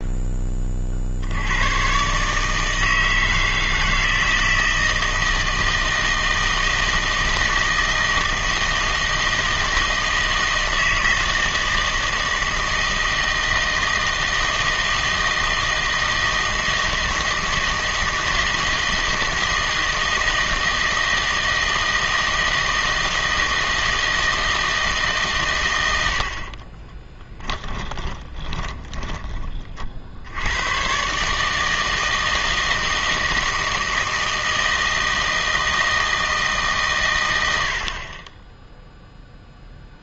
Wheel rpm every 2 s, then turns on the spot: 30, 150, 160, 160, 160, 160, 160, 160, 160, 160, 160, 160, 160, 50, 20, 110, 160, 160, 150, 10.
26-30